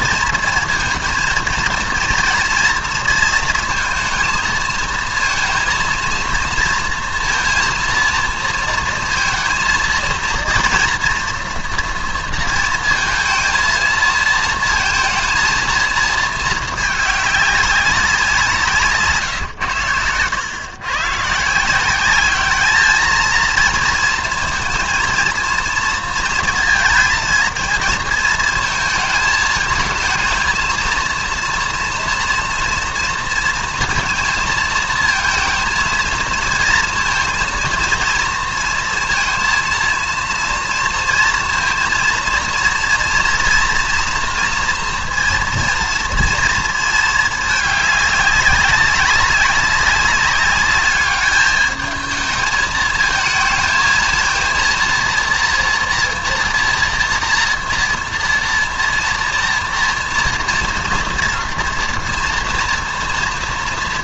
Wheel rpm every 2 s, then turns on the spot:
230, 230, 230, 230, 230, 240, 230, 220, 210, 150, 120, 220, 230, 230, 220, 230, 230, 230, 230, 230, 230, 240, 230, 220, 200, 210, 220, 230, 240, 230, 230, 230.
none